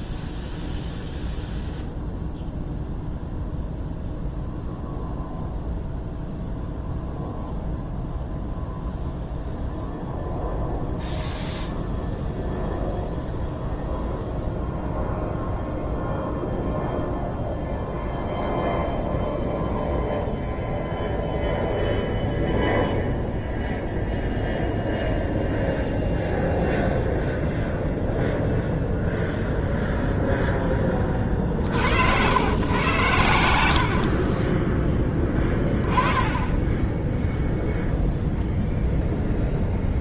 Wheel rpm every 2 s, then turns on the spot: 0, 0, 0, 0, 0, 0, 0, 0, 0, 0, 0, 0, 0, 0, 0, 10, 110, 20, 10, 0.
none